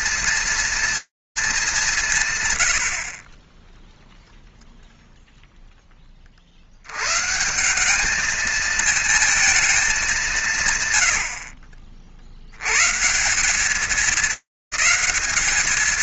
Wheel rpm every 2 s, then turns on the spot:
210, 30, 0, 140, 230, 100, 180, 220.
none